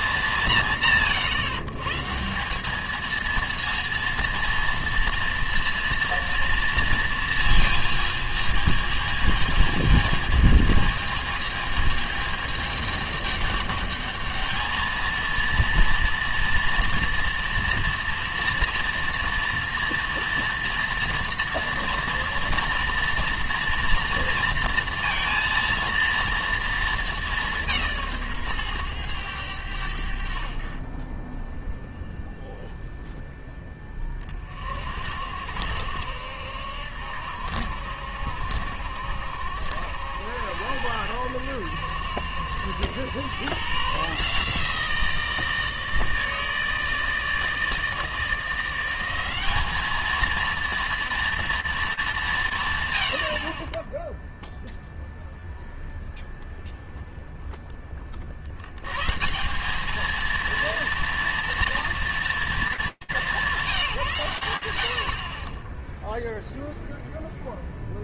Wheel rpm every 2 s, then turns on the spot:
160, 190, 230, 230, 220, 220, 210, 220, 230, 240, 230, 240, 230, 230, 130, 40, 0, 40, 70, 70, 90, 90, 160, 160, 170, 230, 120, 0, 0, 90, 230, 200, 80, 0.
none